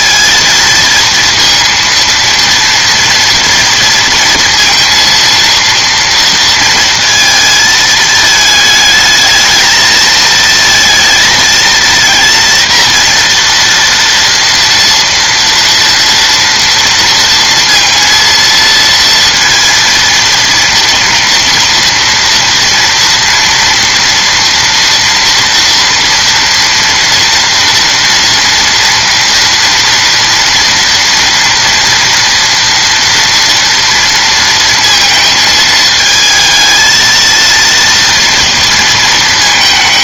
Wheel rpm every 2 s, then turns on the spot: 230, 230, 230, 230, 220, 220, 230, 230, 230, 230, 230, 230, 230, 230, 230, 230, 230, 230, 220, 230.
none